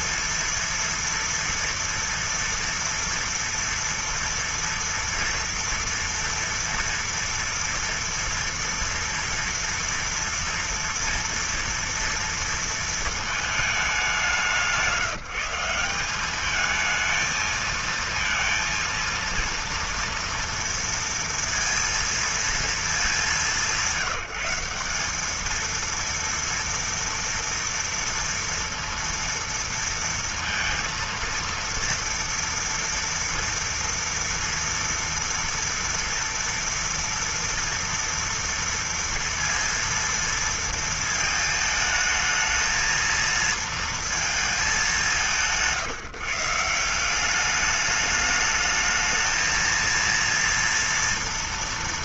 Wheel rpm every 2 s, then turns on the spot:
240, 240, 230, 230, 230, 230, 230, 190, 190, 230, 230, 230, 170, 230, 230, 230, 230, 230, 230, 230, 230, 220, 230, 160, 210, 230.
none